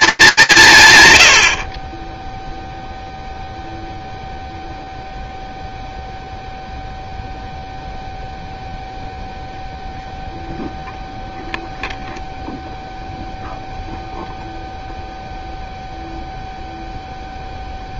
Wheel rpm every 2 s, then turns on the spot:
170, 0, 0, 0, 0, 0, 0, 0, 0.
none